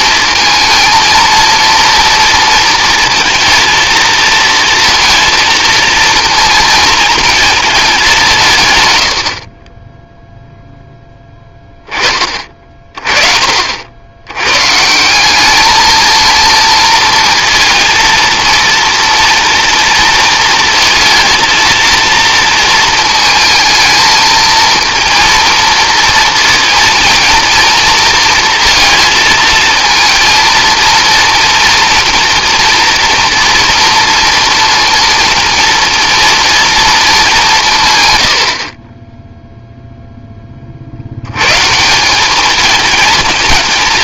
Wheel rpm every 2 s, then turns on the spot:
230, 230, 230, 230, 90, 0, 30, 140, 220, 230, 230, 230, 230, 230, 230, 230, 240, 230, 230, 30, 40, 220.
none